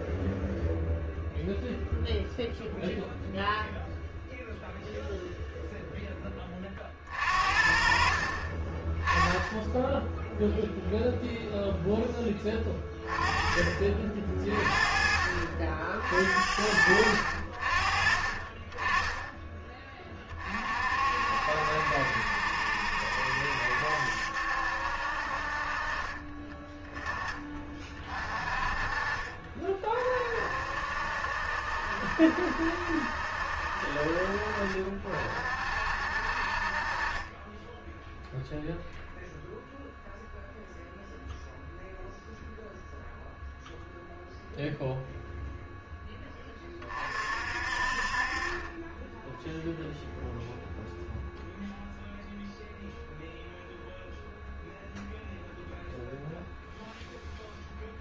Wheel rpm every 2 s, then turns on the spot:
0, 0, 0, 40, 10, 0, 20, 40, 60, 30, 60, 70, 60, 20, 40, 60, 70, 50, 30, 0, 0, 0, 0, 30, 20, 0, 0, 0, 0.
none